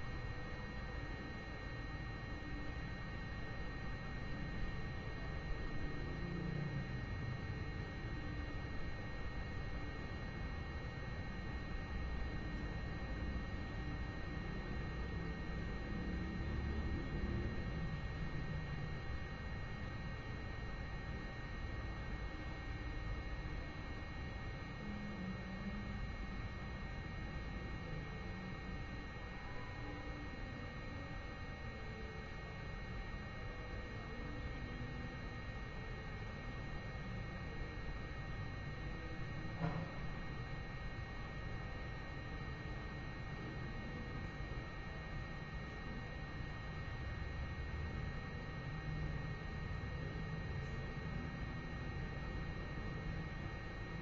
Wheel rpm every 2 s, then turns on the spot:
0, 0, 0, 0, 0, 0, 0, 0, 0, 0, 0, 0, 0, 0, 0, 0, 0, 0, 0, 0, 0, 0, 0, 0, 0, 0, 0.
none